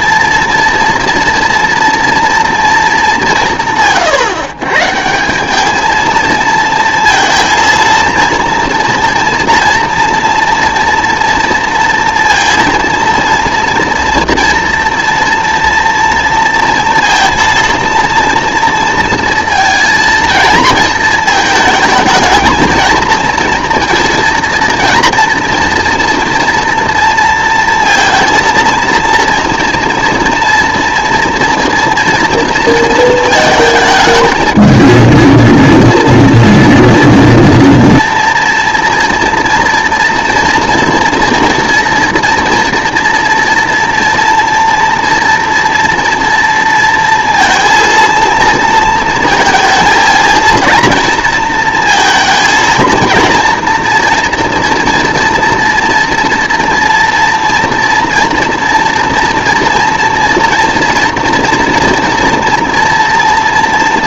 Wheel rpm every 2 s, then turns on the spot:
230, 230, 130, 230, 230, 230, 230, 230, 230, 230, 230, 220, 230, 230, 230, 230, 230, 220, 240, 230, 230, 240, 230, 230, 230, 230, 220, 240, 240, 230, 230, 230.
none